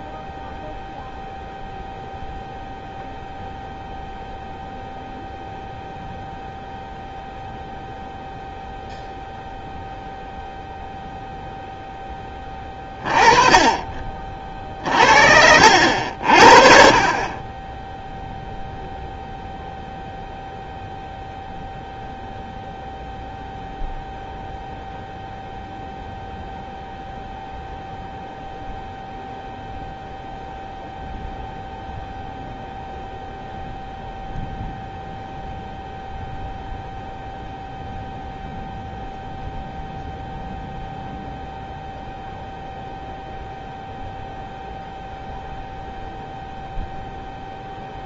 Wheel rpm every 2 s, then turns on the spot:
0, 0, 0, 0, 0, 0, 20, 50, 40, 0, 0, 0, 0, 0, 0, 0, 0, 0, 0, 0, 0, 0, 0, 0.
14-16